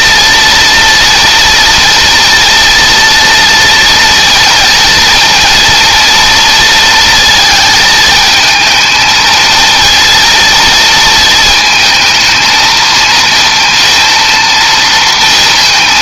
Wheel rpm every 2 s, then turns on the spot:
230, 230, 230, 230, 220, 230, 220, 230.
none